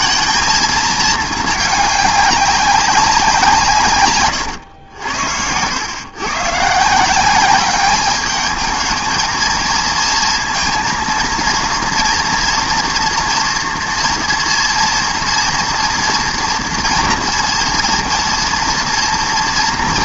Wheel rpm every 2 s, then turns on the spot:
220, 200, 110, 150, 220, 230, 230, 240, 230, 230.
4-6